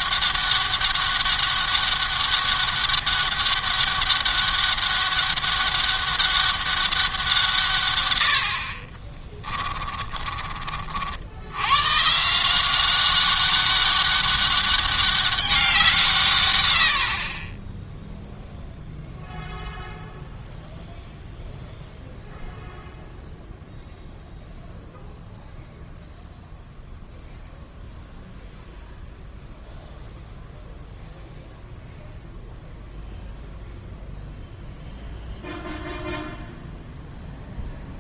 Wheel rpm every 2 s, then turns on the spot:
200, 200, 200, 190, 40, 60, 190, 200, 90, 0, 0, 0, 0, 0, 0, 0, 0, 0, 0.
8-10